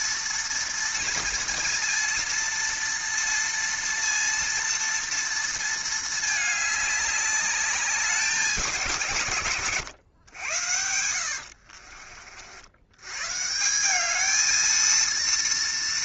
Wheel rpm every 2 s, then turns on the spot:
230, 230, 230, 220, 190, 110, 40, 200.
10-12